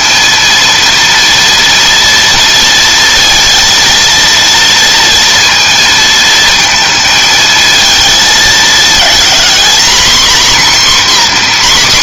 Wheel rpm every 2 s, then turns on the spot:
230, 230, 230, 220, 220, 260.
none